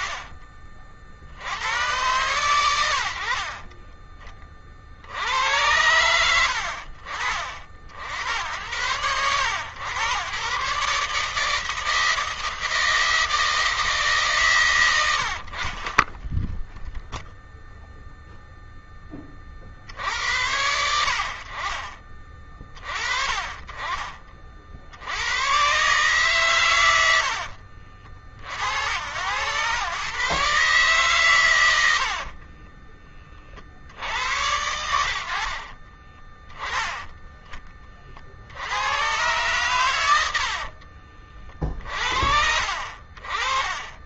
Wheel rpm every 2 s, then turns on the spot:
40, 110, 30, 70, 100, 140, 160, 130, 0, 10, 80, 30, 70, 120, 80, 140, 30, 80, 10, 100, 70, 40.
32-34 40-42